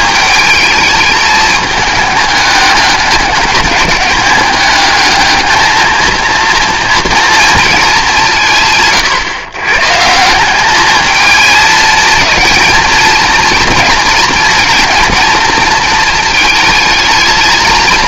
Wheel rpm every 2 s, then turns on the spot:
220, 210, 210, 230, 140, 200, 220, 230, 220.
none